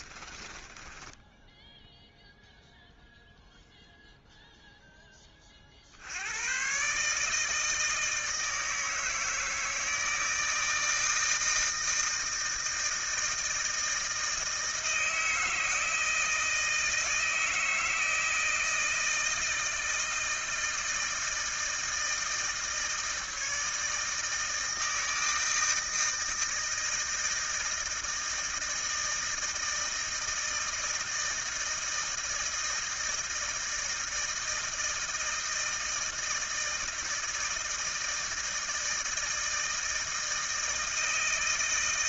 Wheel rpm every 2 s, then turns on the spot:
20, 0, 0, 120, 160, 160, 160, 160, 160, 160, 160, 160, 160, 160, 160, 160, 160, 160, 160, 160, 160.
0-2